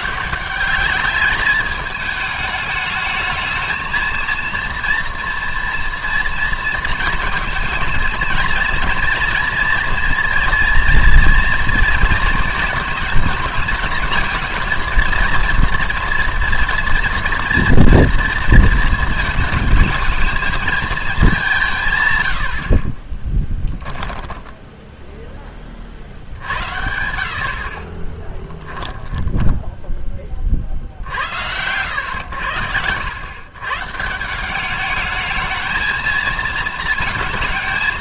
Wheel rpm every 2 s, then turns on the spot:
200, 220, 240, 230, 230, 230, 230, 230, 230, 220, 220, 70, 10, 70, 10, 40, 90, 190, 230.
28-30